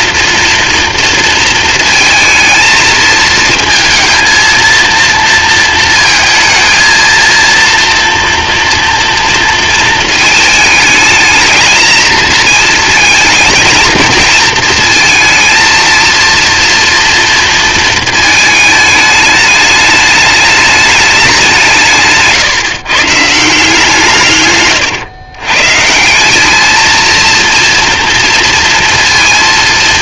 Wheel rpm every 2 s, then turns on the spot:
230, 220, 230, 230, 230, 220, 220, 230, 230, 210, 210, 150, 120, 230, 230.
none